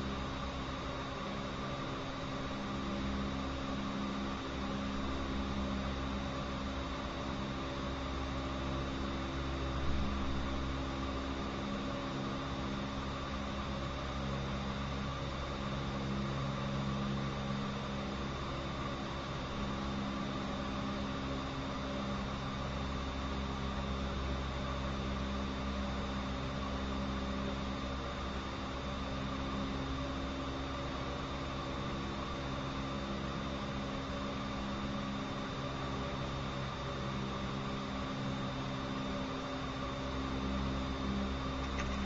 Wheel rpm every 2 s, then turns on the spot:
0, 0, 0, 0, 0, 0, 0, 0, 0, 0, 0, 0, 0, 0, 0, 0, 0, 0, 0, 0, 0.
none